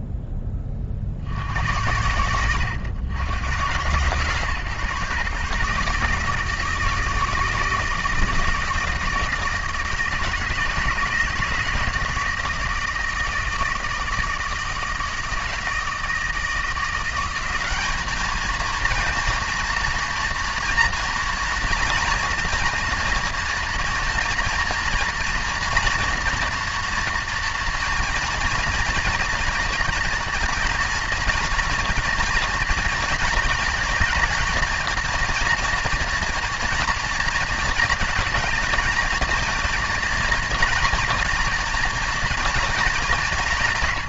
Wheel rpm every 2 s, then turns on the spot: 30, 110, 130, 160, 170, 160, 160, 160, 180, 230, 230, 240, 240, 240, 230, 240, 230, 230, 230, 230, 230, 190.
none